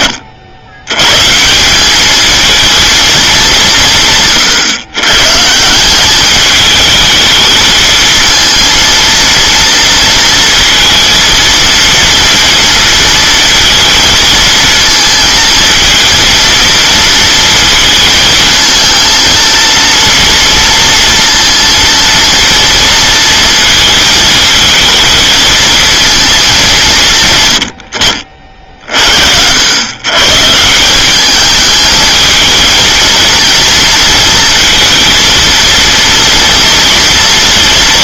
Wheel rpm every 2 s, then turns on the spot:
40, 220, 150, 200, 230, 230, 230, 230, 230, 220, 230, 230, 220, 210, 70, 150, 220, 230, 230.
none